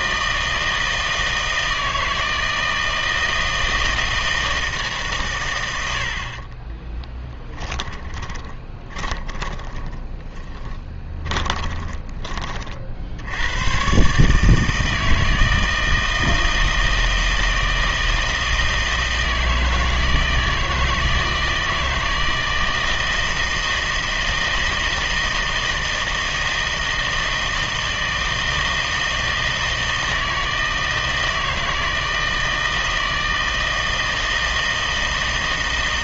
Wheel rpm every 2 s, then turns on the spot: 160, 160, 160, 30, 30, 20, 40, 150, 160, 160, 160, 160, 160, 160, 160, 160, 160, 160.
6-12